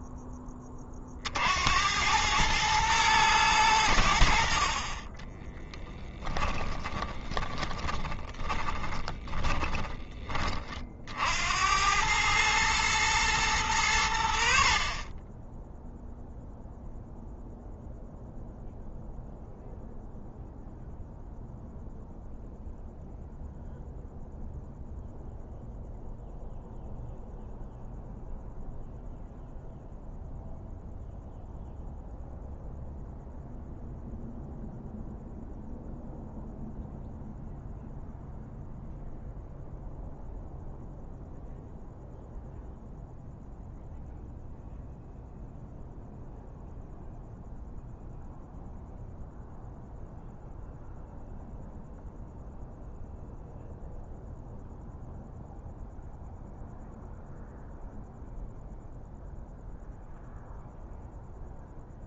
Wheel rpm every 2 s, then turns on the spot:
30, 110, 30, 20, 20, 40, 110, 30, 0, 0, 0, 0, 0, 0, 0, 0, 0, 0, 0, 0, 0, 0, 0, 0, 0, 0, 0, 0, 0, 0, 0.
6-10